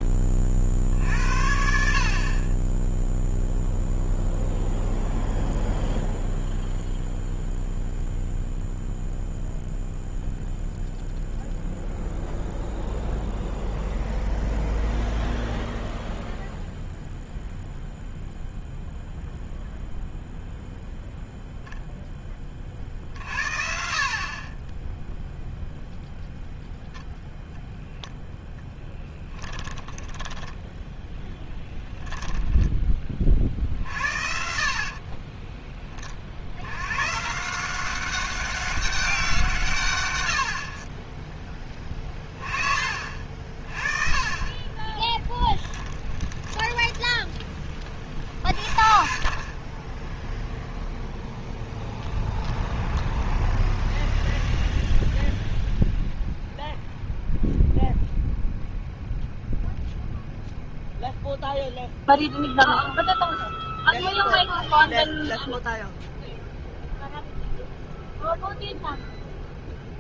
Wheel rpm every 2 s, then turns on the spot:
40, 30, 0, 0, 0, 0, 0, 0, 0, 0, 0, 30, 20, 0, 10, 10, 10, 60, 50, 190, 70, 30, 50, 10, 0, 0, 10, 0, 0, 0, 0, 0, 0, 0, 0.
30-34 46-48 52-54